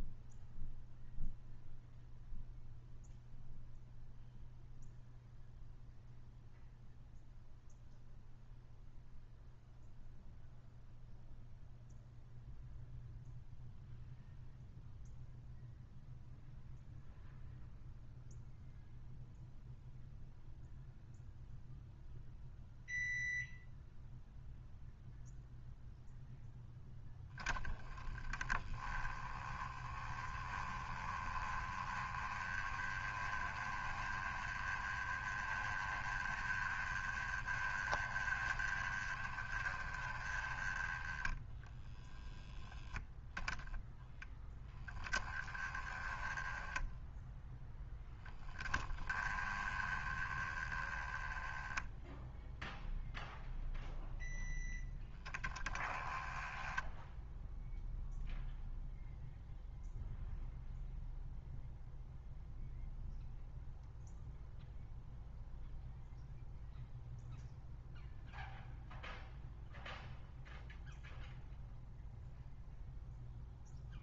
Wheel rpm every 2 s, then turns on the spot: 0, 0, 0, 0, 0, 0, 0, 0, 0, 0, 0, 0, 0, 10, 10, 20, 20, 20, 20, 20, 10, 10, 10, 10, 10, 10, 0, 0, 0, 0, 0, 0, 0, 0, 0, 0, 0.
none